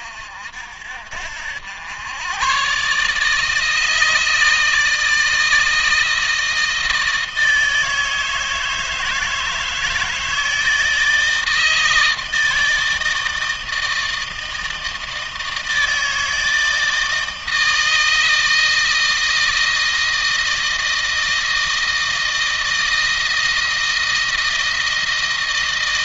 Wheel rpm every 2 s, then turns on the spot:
60, 130, 160, 160, 160, 160, 160, 160, 160, 160, 160, 160, 160.
none